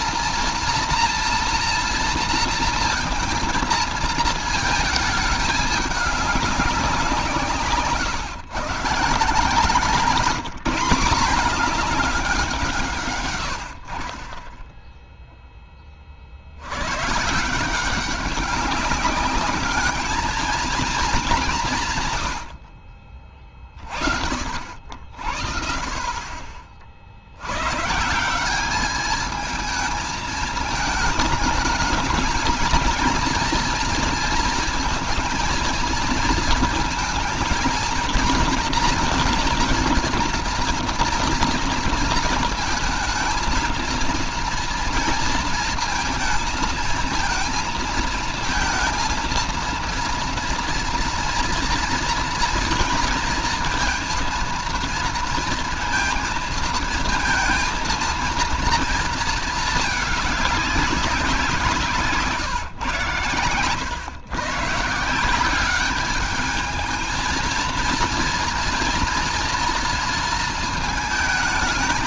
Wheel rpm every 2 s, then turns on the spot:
230, 230, 220, 200, 140, 180, 170, 10, 80, 200, 220, 80, 50, 40, 200, 220, 220, 230, 220, 230, 230, 220, 230, 230, 230, 240, 230, 230, 230, 230, 190, 130, 140, 210, 230, 230.
none